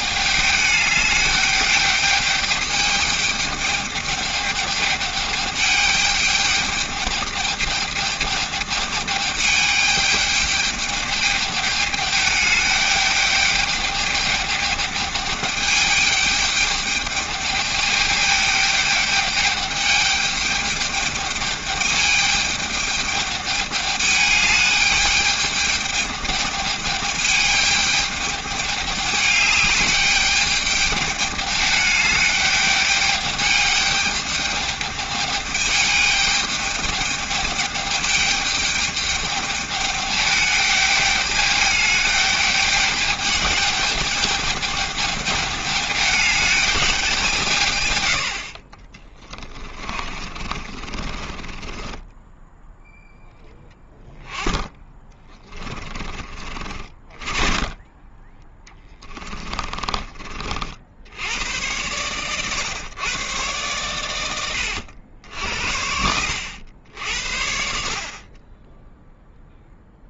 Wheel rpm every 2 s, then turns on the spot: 210, 210, 210, 210, 210, 210, 210, 210, 210, 210, 210, 210, 210, 210, 210, 210, 210, 210, 210, 210, 210, 210, 210, 210, 80, 30, 20, 10, 20, 10, 30, 110, 110, 70, 40.
50-54